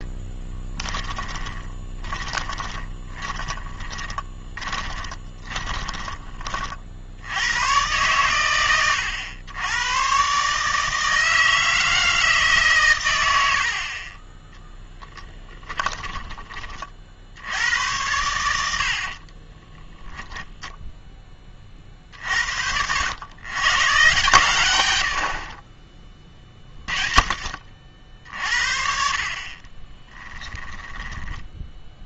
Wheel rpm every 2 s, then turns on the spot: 10, 20, 20, 50, 110, 150, 140, 10, 30, 70, 0, 80, 100, 30, 50, 10.
0-6 14-16